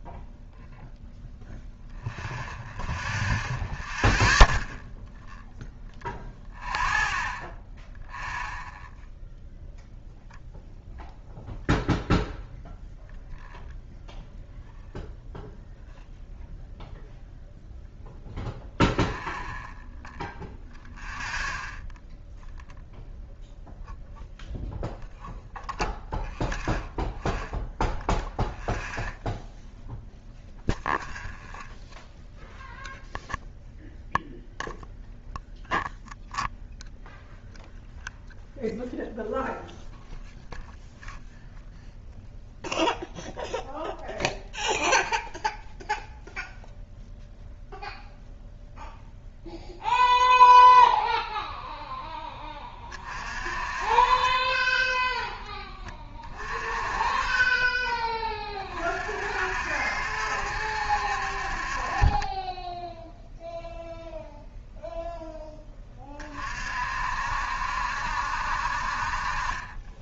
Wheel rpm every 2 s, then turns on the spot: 0, 0, 0, 0, 0, 0, 0, 0, 0, 0, 0, 0, 0, 0, 0, 0, 0, 0, 0, 0, 0, 0, 0, 0, 0, 0, 30, 10, 30, 40, 60, 10, 0, 50, 50.
none